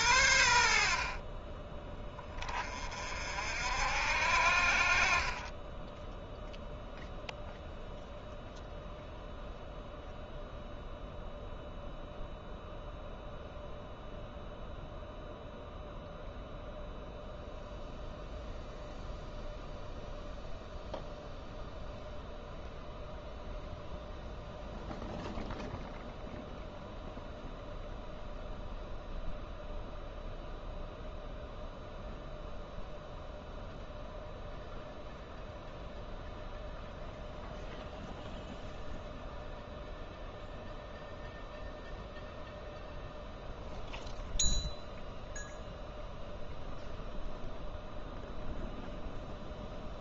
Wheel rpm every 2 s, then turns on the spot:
60, 40, 50, 0, 0, 0, 0, 0, 0, 0, 0, 0, 0, 0, 0, 0, 0, 0, 0, 0, 0, 0, 0, 0, 0.
none